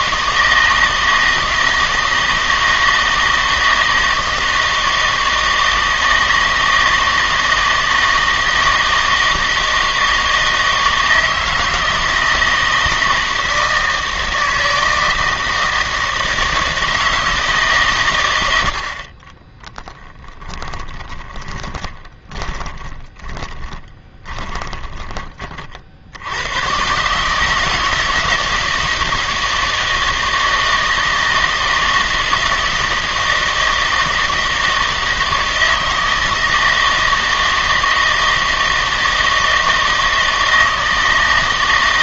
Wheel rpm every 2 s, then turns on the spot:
160, 160, 160, 160, 160, 160, 160, 160, 160, 70, 10, 20, 20, 120, 160, 160, 160, 160, 160, 160, 160.
20-26